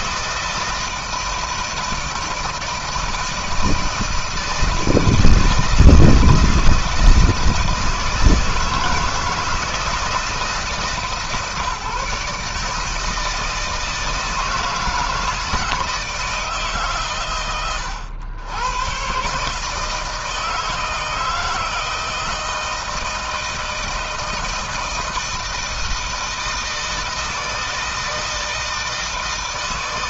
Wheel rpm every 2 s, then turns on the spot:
160, 160, 160, 160, 160, 160, 160, 160, 150, 130, 160, 160, 160, 160, 160.
none